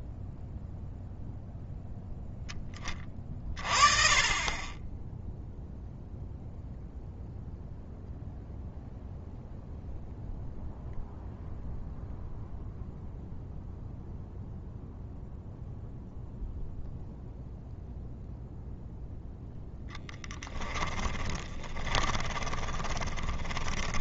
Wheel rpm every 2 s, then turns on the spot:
0, 20, 20, 0, 0, 0, 0, 0, 0, 0, 10, 20.
20-24